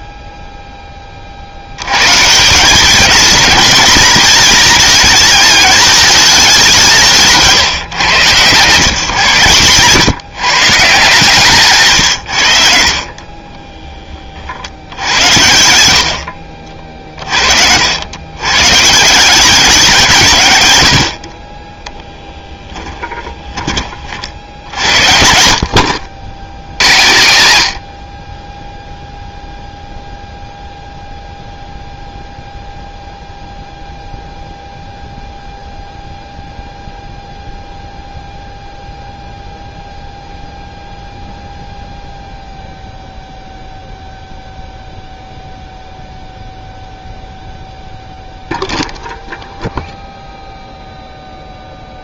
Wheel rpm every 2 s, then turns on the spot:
40, 220, 210, 160, 120, 160, 30, 70, 40, 150, 70, 10, 70, 110, 0, 0, 0, 0, 0, 0, 0, 0, 0, 0, 0, 0.
22-24